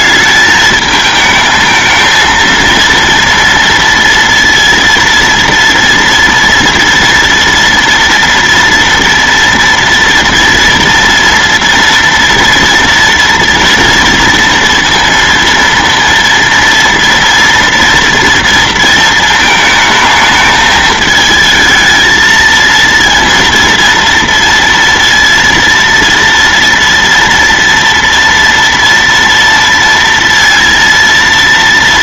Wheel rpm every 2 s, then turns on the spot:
220, 230, 230, 230, 230, 230, 230, 230, 230, 230, 220, 230, 230, 230, 230, 230.
none